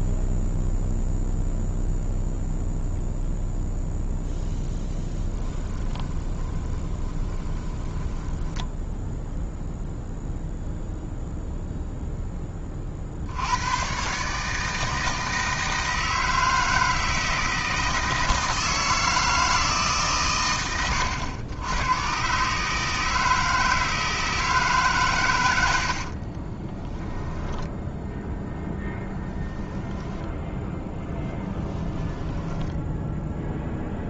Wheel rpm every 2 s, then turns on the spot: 0, 0, 10, 20, 10, 0, 50, 160, 160, 160, 90, 150, 140, 10, 10, 20, 10.
4-8 26-28 32-34